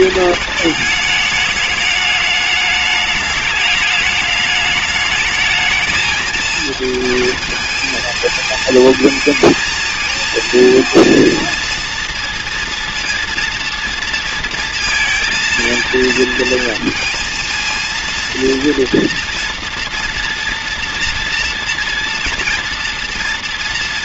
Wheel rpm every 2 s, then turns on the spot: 210, 210, 210, 220, 220, 230, 230, 230, 230, 230, 240, 230.
none